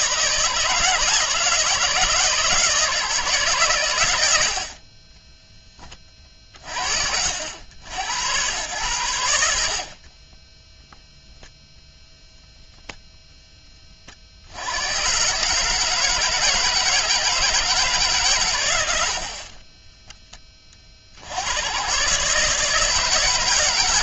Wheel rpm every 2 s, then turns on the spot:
160, 160, 30, 50, 100, 0, 0, 110, 160, 100, 40, 160.
none